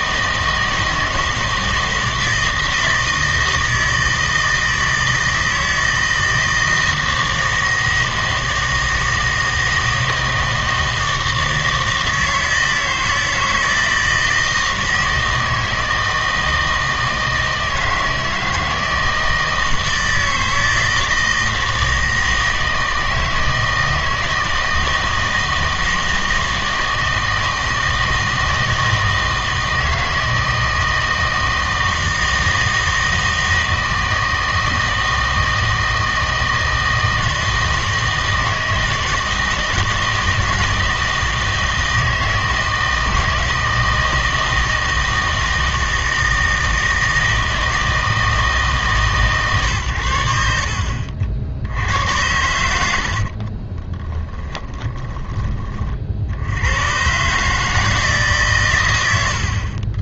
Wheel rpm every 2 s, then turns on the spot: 160, 160, 160, 160, 160, 160, 160, 160, 160, 160, 160, 160, 160, 160, 160, 160, 160, 160, 160, 160, 160, 160, 160, 160, 150, 60, 80, 20, 100, 110.
54-56